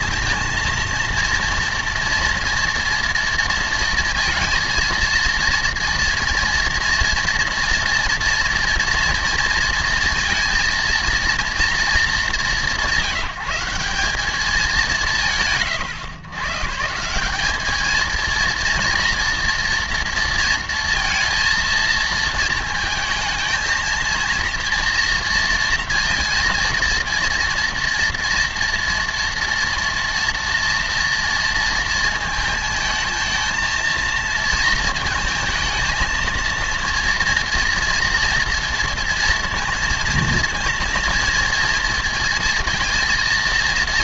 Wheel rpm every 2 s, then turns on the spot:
230, 230, 230, 230, 230, 230, 170, 170, 180, 230, 230, 220, 230, 230, 230, 230, 230, 230, 230, 230, 230, 230.
none